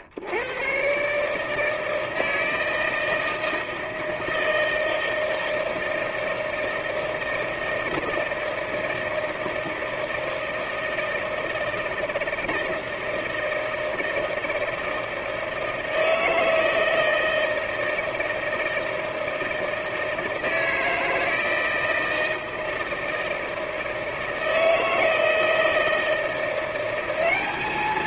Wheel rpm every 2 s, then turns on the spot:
110, 160, 160, 160, 160, 160, 160, 160, 160, 160, 160, 160, 160, 170.
none